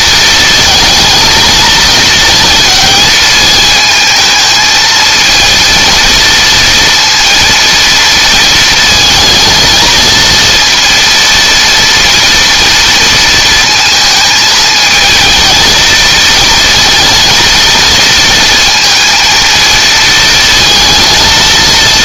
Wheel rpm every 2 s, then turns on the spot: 220, 220, 220, 230, 230, 230, 230, 220, 220, 230, 220.
none